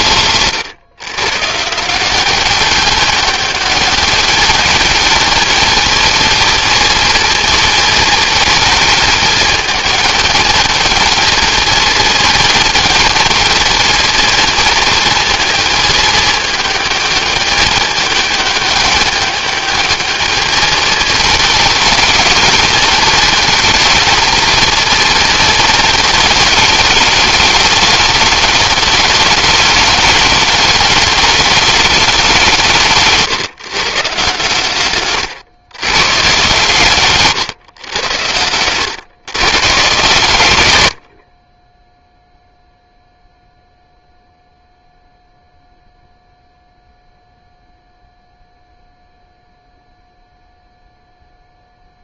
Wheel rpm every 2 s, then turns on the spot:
140, 210, 220, 220, 220, 220, 220, 220, 210, 210, 210, 220, 220, 210, 210, 210, 150, 110, 130, 130, 20, 0, 0, 0, 0, 0.
none